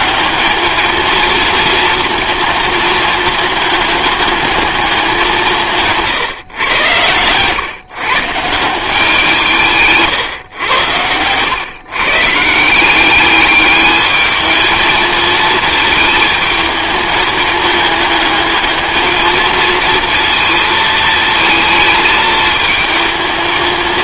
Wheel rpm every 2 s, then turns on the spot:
220, 220, 210, 110, 180, 110, 180, 220, 220, 220, 230, 220.
none